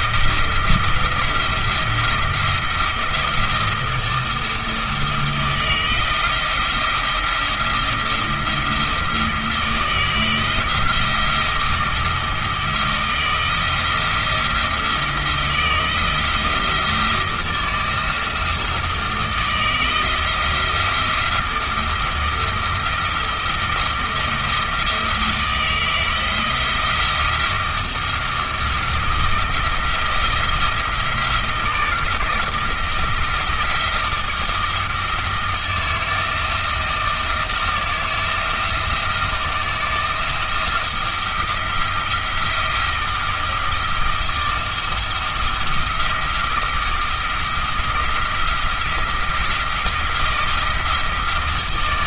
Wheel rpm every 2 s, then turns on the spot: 170, 170, 170, 170, 170, 160, 160, 170, 170, 160, 170, 170, 170, 160, 170, 160, 160, 160, 160, 160, 170, 170, 170, 170, 170, 160.
none